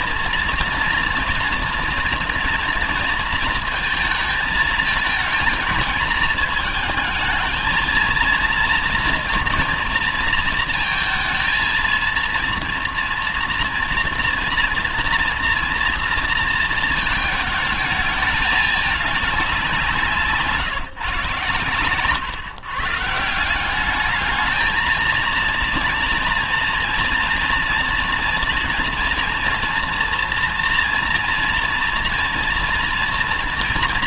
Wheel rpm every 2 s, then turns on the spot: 240, 230, 220, 220, 230, 230, 230, 240, 230, 210, 160, 120, 210, 230, 240, 230, 240.
none